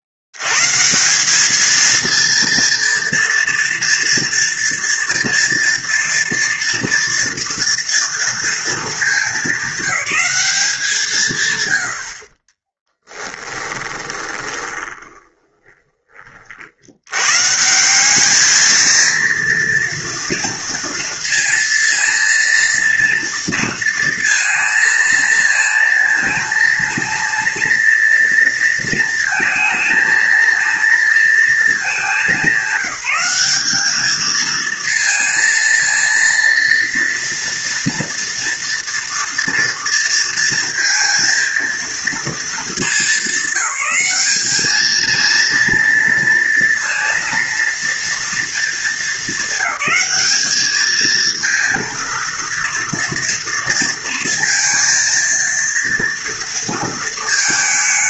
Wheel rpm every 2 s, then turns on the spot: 70, 230, 240, 230, 230, 200, 30, 20, 50, 210, 230, 230, 230, 230, 230, 230, 190, 220, 230, 230, 230, 220, 210, 230, 230, 210, 230, 230, 230.
12-16